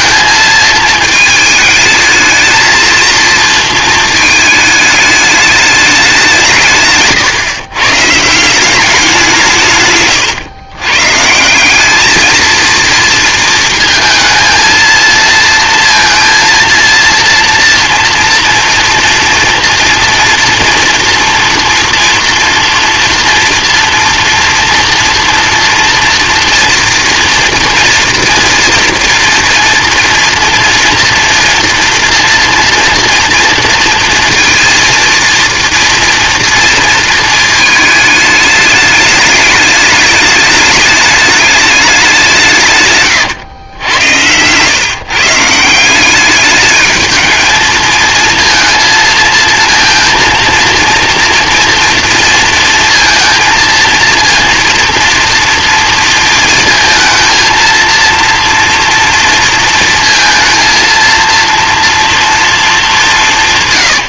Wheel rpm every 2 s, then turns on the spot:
220, 220, 210, 160, 180, 120, 230, 220, 230, 230, 230, 230, 240, 230, 230, 230, 240, 230, 230, 210, 210, 160, 110, 210, 230, 230, 230, 230, 230, 230, 230, 220.
none